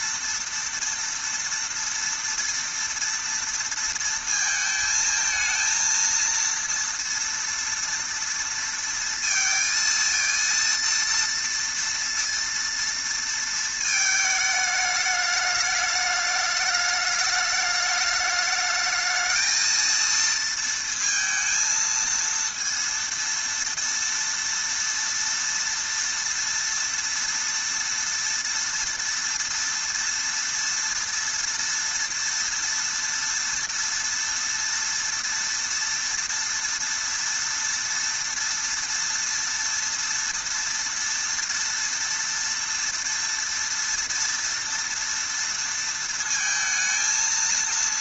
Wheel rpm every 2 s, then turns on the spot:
230, 230, 220, 230, 230, 230, 230, 220, 210, 210, 230, 230, 230, 230, 230, 240, 240, 230, 230, 230, 230, 230, 230, 230.
none